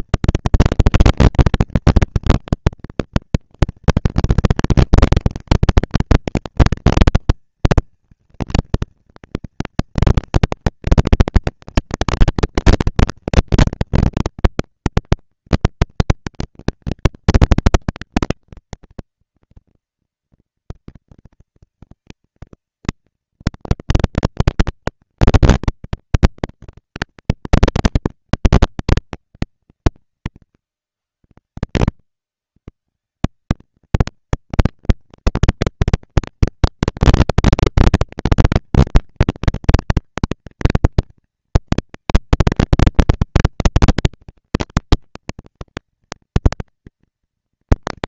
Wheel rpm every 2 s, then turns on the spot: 230, 240, 230, 230, 230, 220, 240, 230, 230, 240, 230, 230, 230, 230, 200, 120, 150, 230, 230, 230, 230, 230, 230, 230.
none